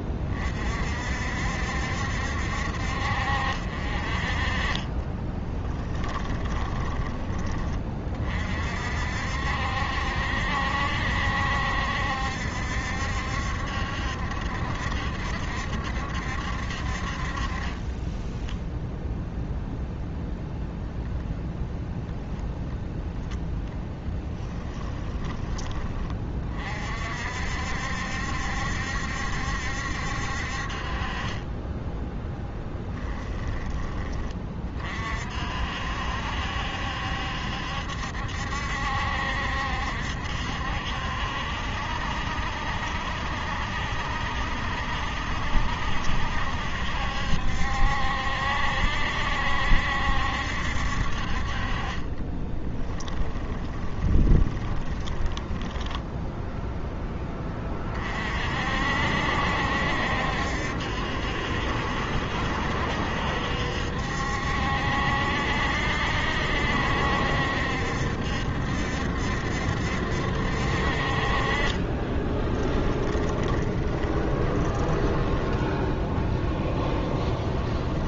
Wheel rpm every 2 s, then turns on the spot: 50, 60, 30, 20, 50, 70, 70, 70, 60, 0, 0, 0, 10, 50, 70, 40, 10, 40, 70, 70, 70, 70, 70, 70, 70, 60, 10, 10, 10, 60, 70, 70, 70, 70, 70, 50, 10, 20, 10.
4-6 24-26 52-56 72-74 76-78